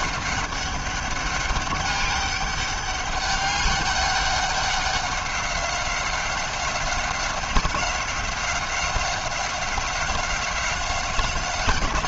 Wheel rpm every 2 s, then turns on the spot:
200, 200, 190, 180, 190, 190.
none